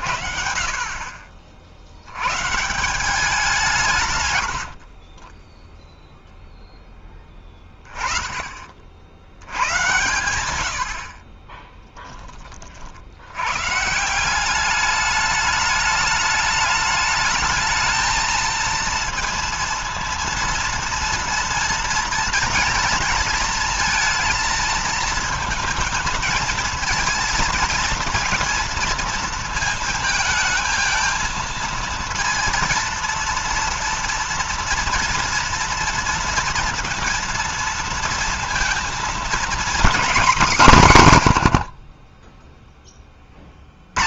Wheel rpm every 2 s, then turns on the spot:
50, 150, 70, 0, 30, 90, 40, 200, 210, 230, 230, 230, 230, 230, 230, 220, 230, 230, 230, 230, 220, 20.
4-6